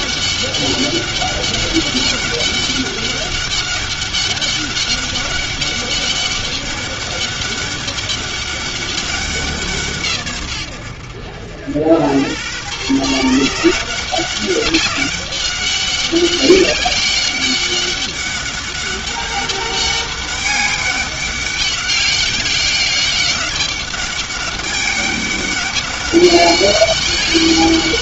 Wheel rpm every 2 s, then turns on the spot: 200, 200, 200, 200, 200, 110, 120, 200, 200, 200, 200, 200, 200, 200.
none